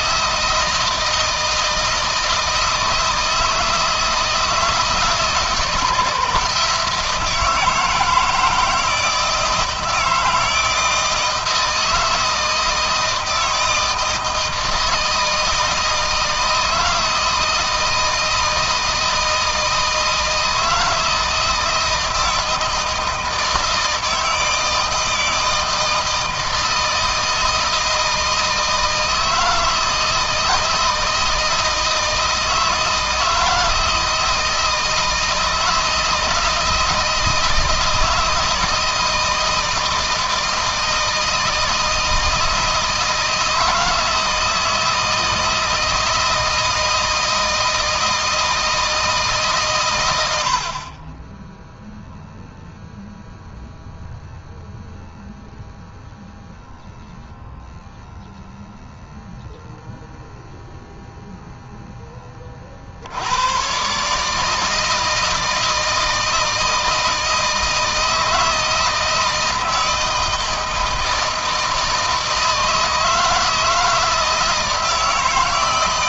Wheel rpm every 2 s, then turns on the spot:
170, 160, 160, 160, 160, 160, 160, 160, 160, 160, 160, 160, 160, 160, 160, 160, 160, 160, 160, 160, 160, 160, 160, 160, 160, 30, 0, 0, 0, 0, 0, 80, 160, 160, 160, 160, 160, 160.
none